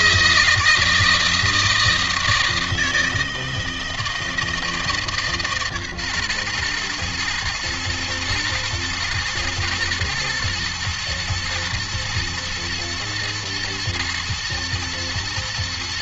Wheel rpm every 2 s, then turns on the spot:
160, 160, 160, 120, 110, 120, 120, 120.
none